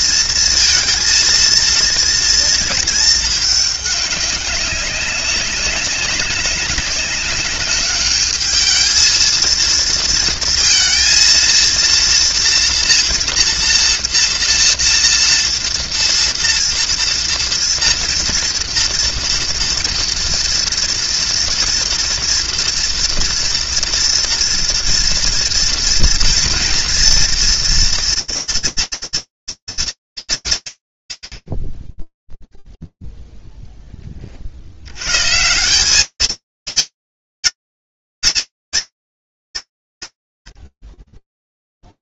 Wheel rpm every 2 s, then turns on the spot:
230, 230, 200, 200, 220, 230, 230, 230, 230, 230, 230, 230, 230, 230, 230, 100, 0, 30, 210, 220, 30.
none